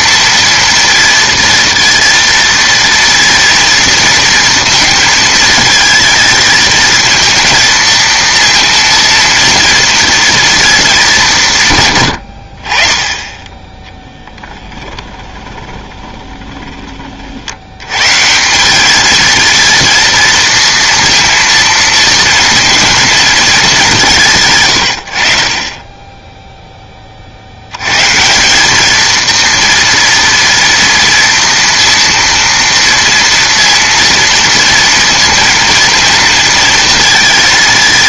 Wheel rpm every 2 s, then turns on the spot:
230, 230, 230, 220, 230, 230, 60, 20, 20, 190, 230, 230, 140, 10, 190, 230, 230, 230, 230.
14-18